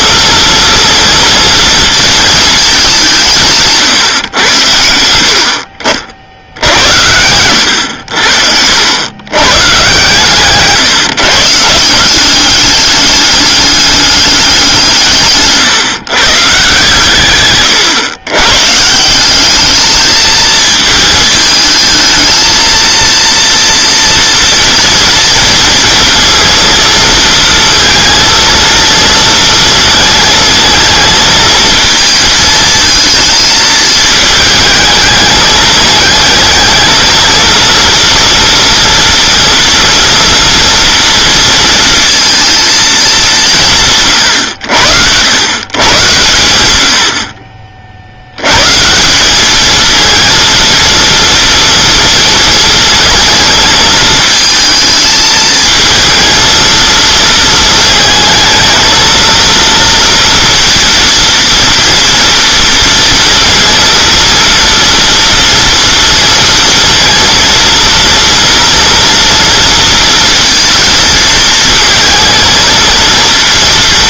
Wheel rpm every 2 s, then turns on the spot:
230, 210, 100, 70, 80, 140, 200, 190, 140, 140, 220, 230, 230, 230, 230, 220, 220, 220, 220, 230, 240, 220, 80, 100, 130, 230, 230, 220, 230, 220, 230, 230, 230, 230, 240, 230, 220.
6-8